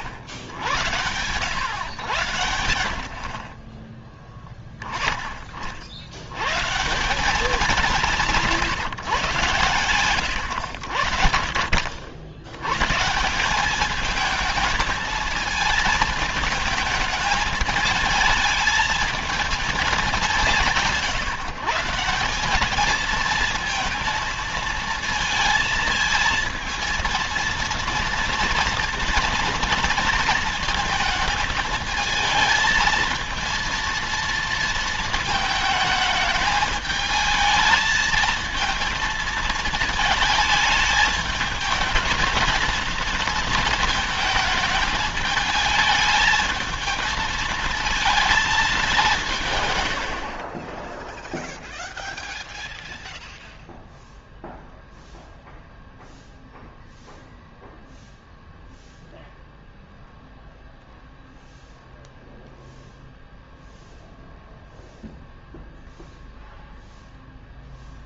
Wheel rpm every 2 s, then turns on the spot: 90, 90, 10, 140, 150, 90, 100, 220, 220, 220, 160, 200, 220, 220, 230, 230, 220, 230, 210, 220, 210, 220, 220, 220, 210, 30, 0, 0, 0, 0, 0, 0, 0, 0.
none